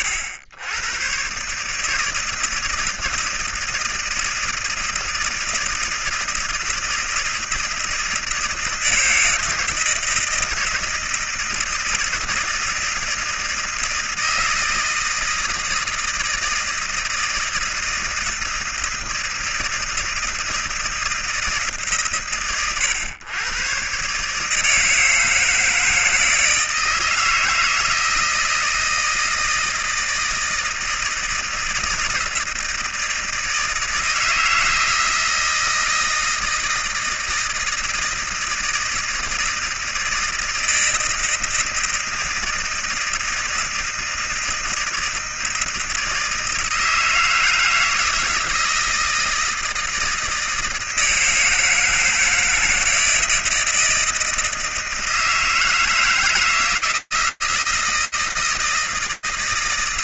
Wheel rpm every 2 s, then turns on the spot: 100, 160, 160, 160, 160, 160, 160, 160, 160, 160, 160, 110, 150, 160, 160, 160, 160, 160, 160, 160, 160, 160, 160, 160, 160, 160, 160, 170, 160, 160.
none